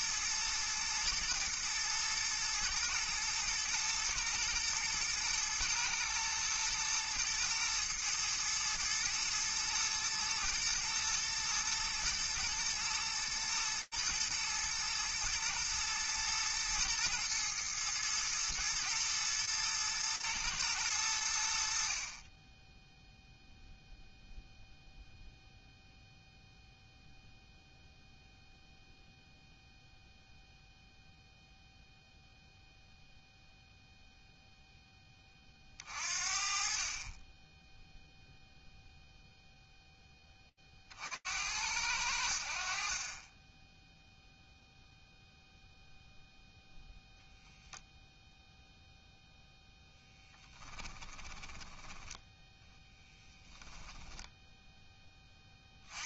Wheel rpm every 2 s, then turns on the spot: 120, 110, 110, 110, 120, 110, 110, 120, 110, 120, 80, 0, 0, 0, 0, 0, 0, 30, 10, 0, 70, 10, 0, 0, 0, 20, 10, 30.
50-54